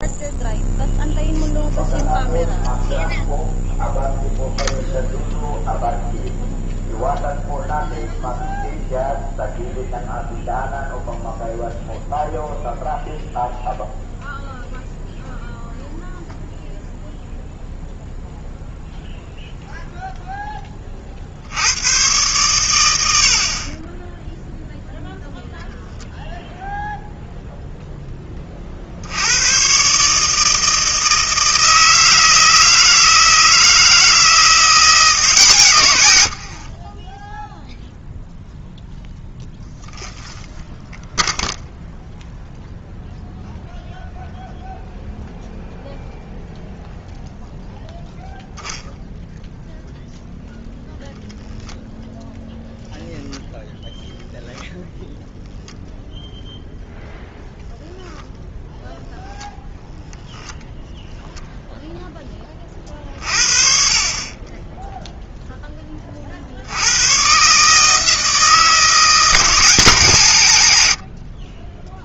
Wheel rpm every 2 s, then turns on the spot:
0, 0, 0, 0, 0, 0, 0, 0, 0, 0, 20, 100, 0, 0, 40, 160, 160, 170, 30, 0, 0, 0, 0, 0, 0, 0, 0, 0, 0, 0, 0, 30, 10, 80, 160, 100.
36-38